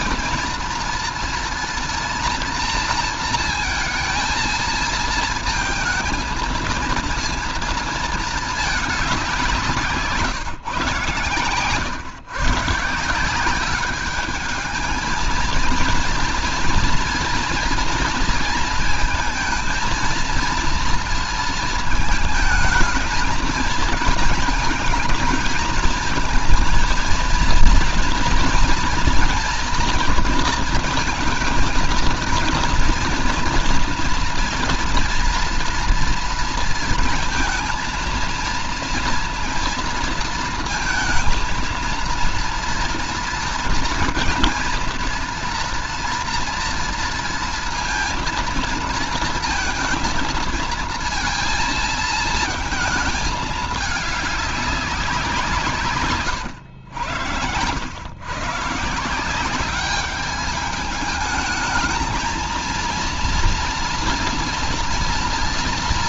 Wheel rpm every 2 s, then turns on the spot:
230, 230, 220, 230, 220, 140, 140, 210, 230, 230, 230, 220, 220, 220, 230, 230, 230, 230, 230, 230, 230, 230, 230, 230, 230, 230, 220, 210, 120, 140, 210, 220, 230.
none